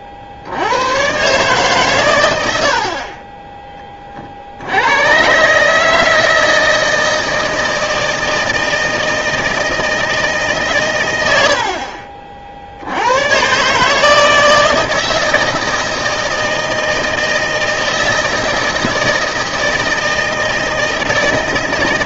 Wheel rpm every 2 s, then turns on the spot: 90, 70, 80, 160, 160, 140, 70, 160, 160, 160, 160.
none